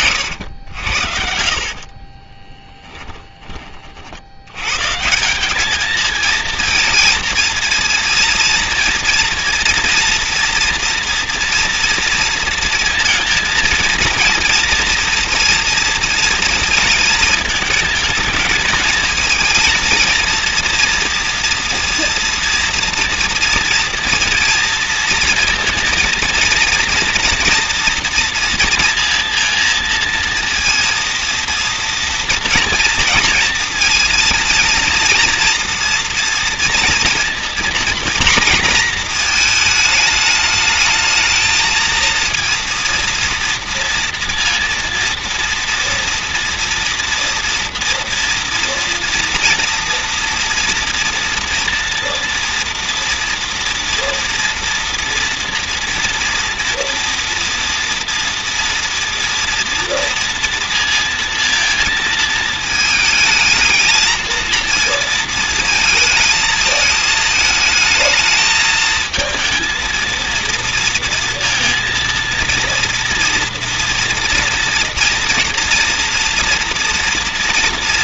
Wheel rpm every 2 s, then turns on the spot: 80, 10, 90, 230, 230, 230, 230, 230, 230, 220, 230, 230, 230, 230, 230, 230, 240, 230, 230, 240, 220, 230, 230, 230, 230, 230, 230, 240, 230, 230, 230, 220, 230, 220, 220, 230, 230, 230, 230.
0-4